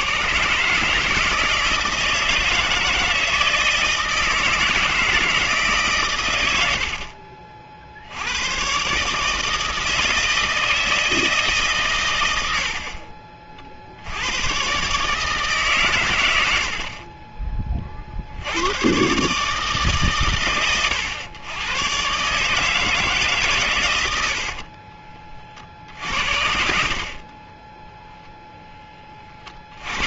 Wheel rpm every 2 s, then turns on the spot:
140, 160, 160, 80, 120, 160, 70, 120, 60, 100, 120, 150, 60, 60, 10.
24-28